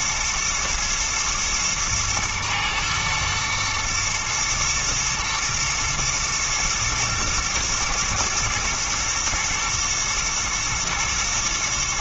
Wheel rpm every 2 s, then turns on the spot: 120, 110, 110, 110, 110, 120.
none